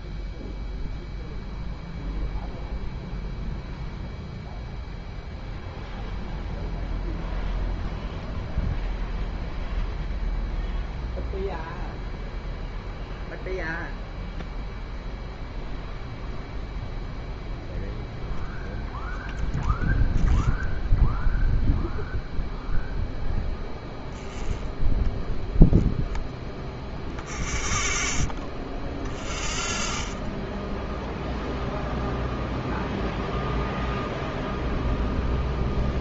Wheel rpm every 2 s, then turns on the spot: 0, 0, 0, 0, 0, 0, 0, 0, 0, 0, 0, 0, 0, 0, 0, 0, 0, 0.
none